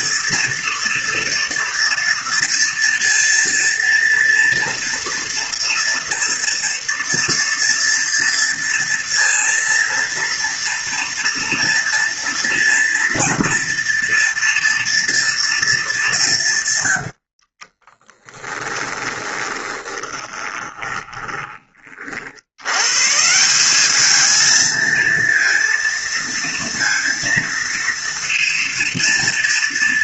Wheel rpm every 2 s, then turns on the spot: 240, 230, 230, 230, 230, 230, 230, 230, 110, 10, 20, 110, 230, 230, 230.
16-22